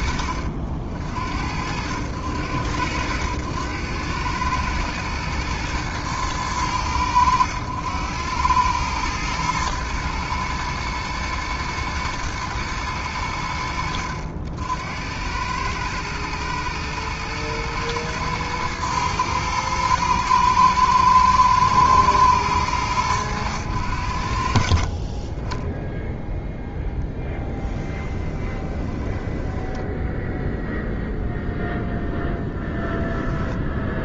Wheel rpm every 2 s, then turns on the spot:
60, 90, 110, 100, 110, 110, 80, 90, 110, 110, 110, 100, 40, 10, 20, 0, 10.
28-30